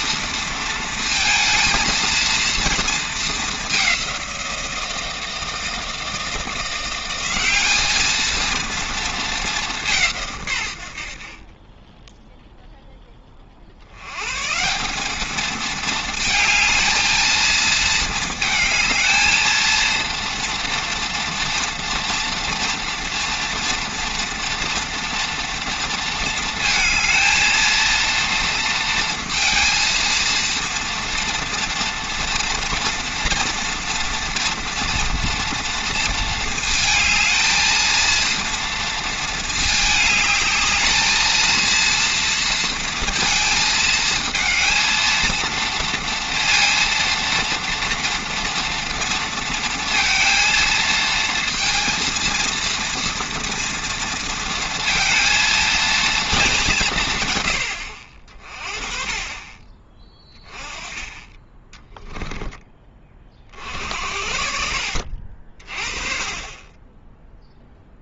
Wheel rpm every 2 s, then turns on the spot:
230, 230, 170, 180, 230, 80, 10, 180, 220, 220, 230, 230, 230, 220, 230, 230, 240, 240, 220, 230, 220, 230, 230, 230, 230, 230, 230, 230, 170, 40, 20, 20, 60, 10.
none